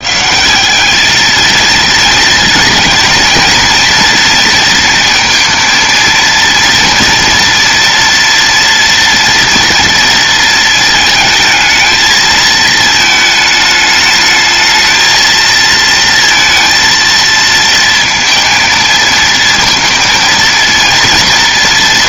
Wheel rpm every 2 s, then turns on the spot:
200, 220, 230, 230, 230, 220, 220, 220, 230, 230, 230.
none